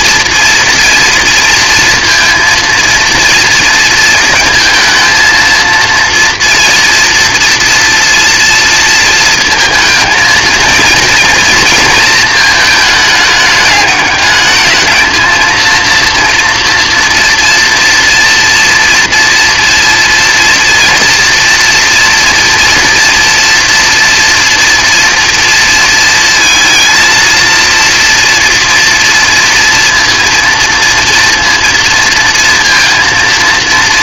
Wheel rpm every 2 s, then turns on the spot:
230, 230, 230, 230, 230, 220, 220, 210, 230, 230, 230, 230, 230, 230, 230, 230, 230.
none